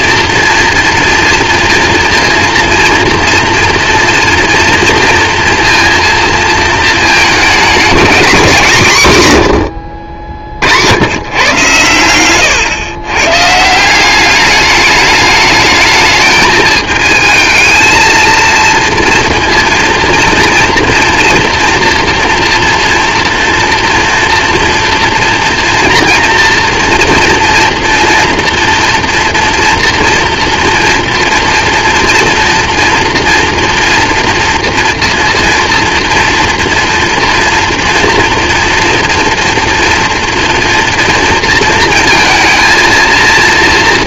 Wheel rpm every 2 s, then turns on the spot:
230, 230, 230, 220, 180, 50, 120, 210, 220, 230, 230, 230, 230, 230, 230, 230, 230, 240, 230, 230, 240, 230.
none